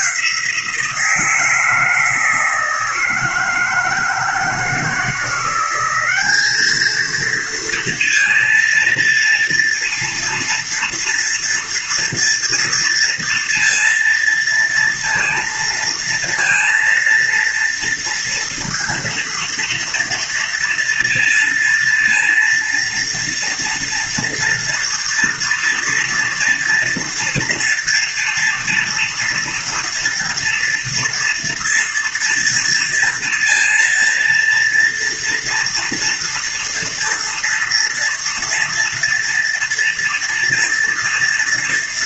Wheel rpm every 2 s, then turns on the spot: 170, 160, 170, 210, 230, 230, 230, 230, 230, 230, 230, 230, 230, 230, 230, 230, 230, 230, 230, 230, 230.
none